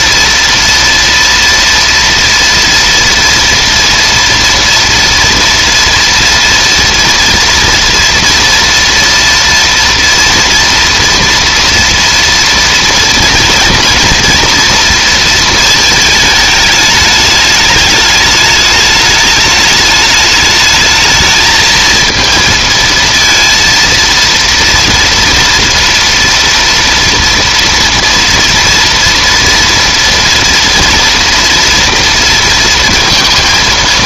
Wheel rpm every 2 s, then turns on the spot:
230, 230, 230, 230, 230, 230, 240, 230, 210, 210, 220, 230, 230, 230, 230, 230, 230.
none